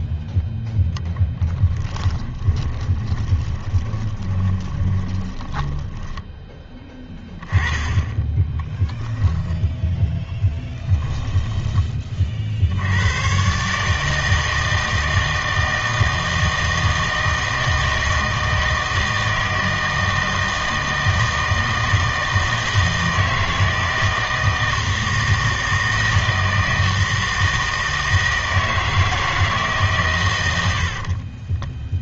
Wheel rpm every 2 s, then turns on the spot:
0, 20, 20, 10, 10, 10, 80, 160, 160, 160, 160, 160, 160, 160, 160, 70.
2-6 8-12